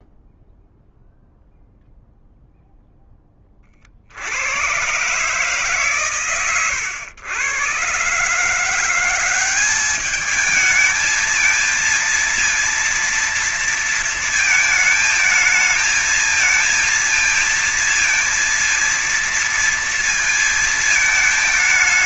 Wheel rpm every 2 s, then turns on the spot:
0, 0, 90, 120, 150, 210, 230, 230, 230, 230, 230.
none